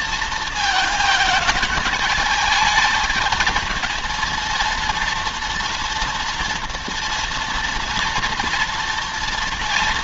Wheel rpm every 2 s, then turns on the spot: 220, 220, 230, 240, 230.
none